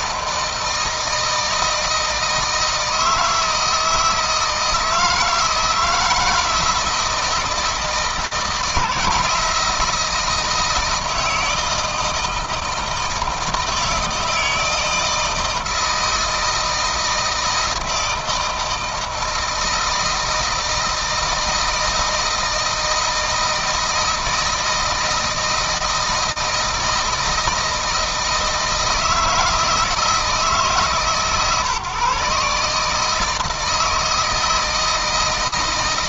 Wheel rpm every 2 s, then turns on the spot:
160, 160, 160, 160, 160, 160, 160, 160, 160, 160, 160, 160, 160, 160, 160, 140, 150, 160.
none